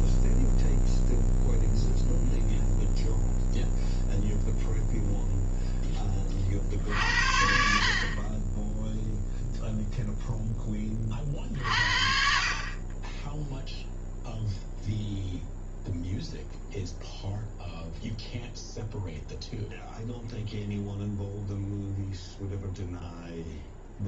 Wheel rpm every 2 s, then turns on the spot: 0, 0, 0, 60, 0, 30, 20, 0, 0, 0, 0, 0.
none